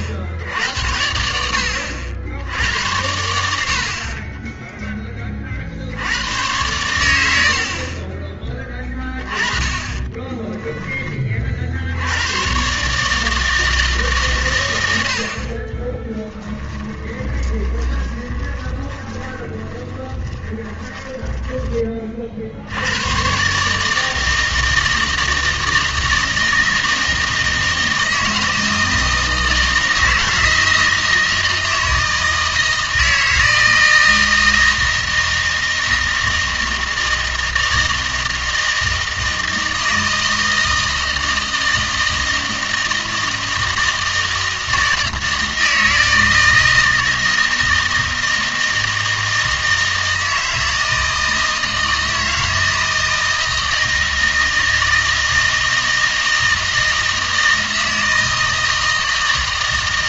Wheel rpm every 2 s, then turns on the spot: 70, 80, 10, 100, 20, 10, 130, 100, 10, 20, 20, 80, 160, 160, 160, 160, 160, 160, 160, 160, 160, 160, 160, 160, 160, 160, 160, 160, 160, 160.
4-6 16-22